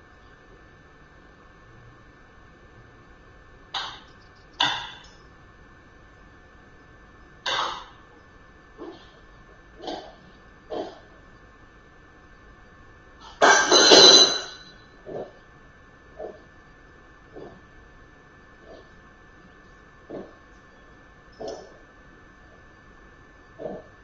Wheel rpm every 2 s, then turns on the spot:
0, 0, 0, 0, 0, 0, 0, 0, 0, 0, 0, 0.
none